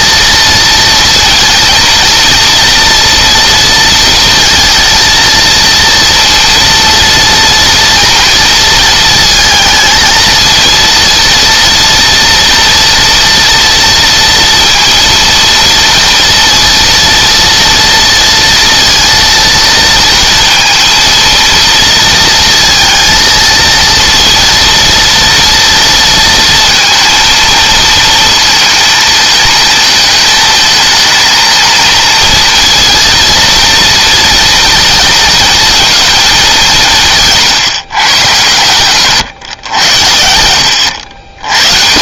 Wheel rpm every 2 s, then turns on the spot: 230, 230, 230, 230, 230, 230, 230, 230, 230, 230, 230, 230, 230, 230, 220, 220, 230, 230, 170, 120, 90.
38-40